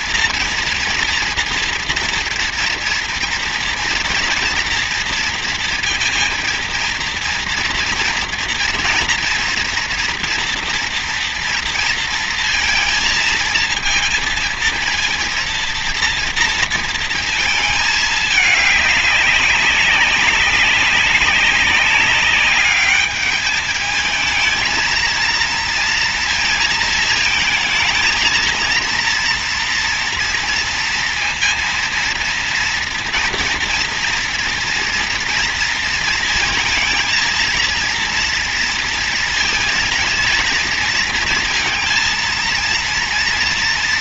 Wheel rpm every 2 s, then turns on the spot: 230, 230, 230, 230, 230, 240, 230, 230, 230, 200, 200, 210, 230, 220, 230, 230, 230, 230, 220, 230, 230, 230.
none